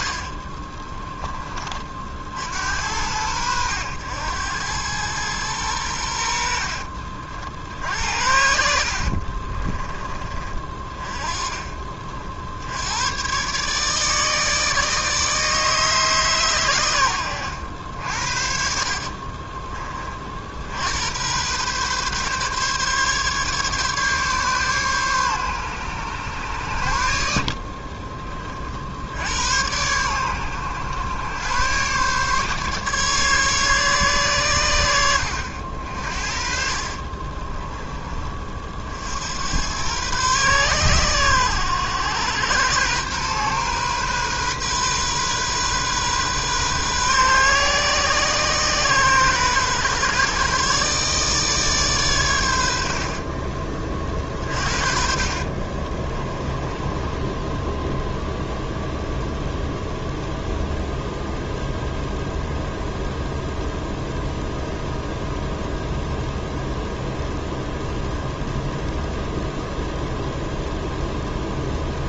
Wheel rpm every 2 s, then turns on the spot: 50, 60, 100, 70, 70, 30, 70, 150, 130, 50, 60, 140, 140, 90, 40, 100, 140, 110, 50, 40, 120, 110, 130, 130, 130, 140, 90, 40, 20, 0, 0, 0, 0, 0, 0, 0.
8-10 36-38 54-58